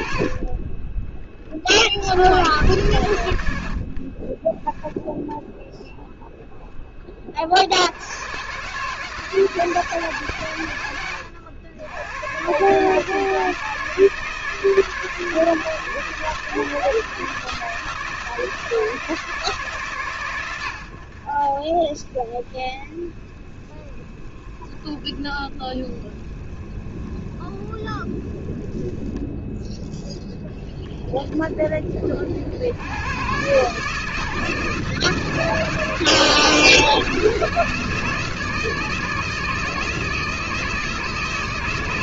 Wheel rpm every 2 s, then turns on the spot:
30, 90, 10, 20, 150, 100, 150, 160, 160, 160, 70, 20, 20, 20, 10, 10, 110, 160, 170, 160, 160.
none